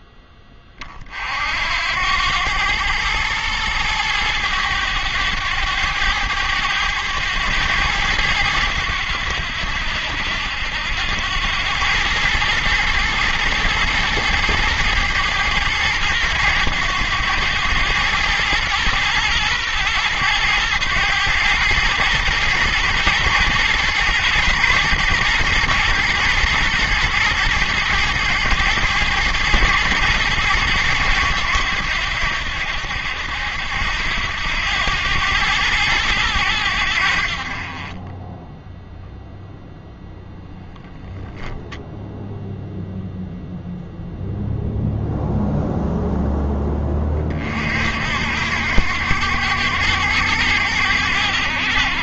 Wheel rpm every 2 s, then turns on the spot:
30, 110, 100, 100, 90, 80, 110, 110, 100, 110, 110, 110, 110, 110, 110, 110, 80, 90, 80, 0, 0, 0, 0, 10, 80, 100.
none